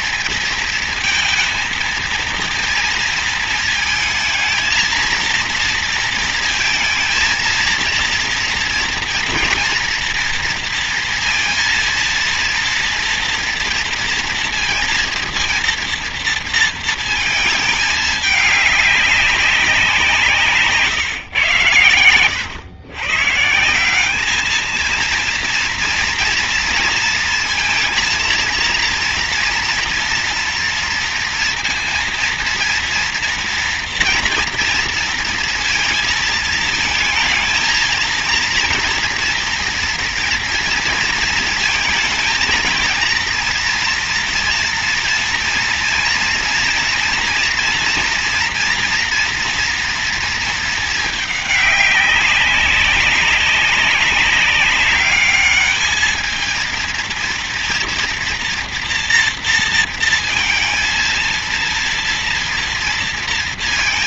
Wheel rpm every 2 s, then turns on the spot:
230, 230, 230, 230, 230, 230, 230, 230, 230, 200, 140, 140, 230, 230, 230, 230, 230, 230, 230, 230, 230, 230, 230, 230, 240, 210, 190, 200, 230, 240, 230, 230.
none